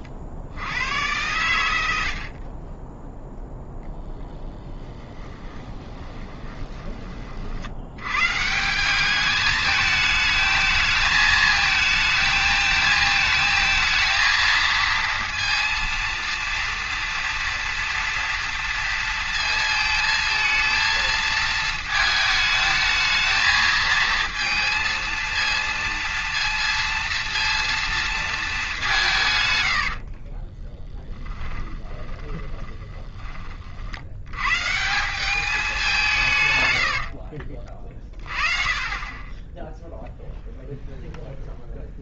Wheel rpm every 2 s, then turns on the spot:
70, 20, 10, 20, 160, 220, 220, 220, 230, 230, 220, 220, 230, 230, 200, 20, 10, 150, 100, 30, 0.
4-8 30-34 36-38